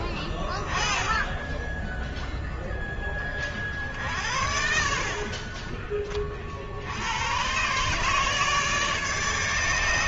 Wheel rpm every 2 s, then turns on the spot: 10, 10, 60, 40, 150.
none